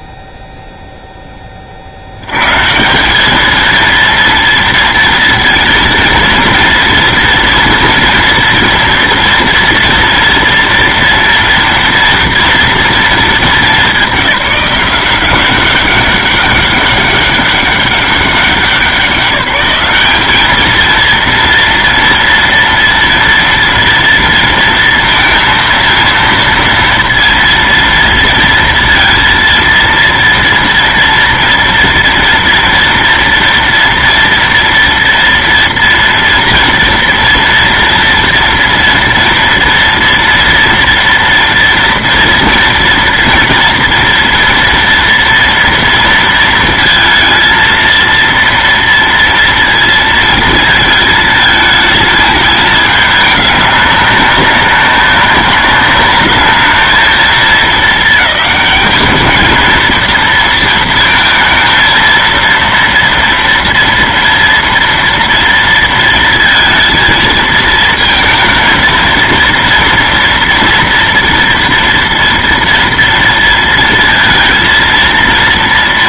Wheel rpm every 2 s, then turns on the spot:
0, 150, 230, 230, 230, 230, 230, 190, 200, 190, 220, 230, 230, 230, 230, 240, 230, 230, 230, 230, 230, 230, 230, 230, 230, 220, 210, 200, 220, 210, 230, 230, 230, 220, 220, 230, 230, 230.
none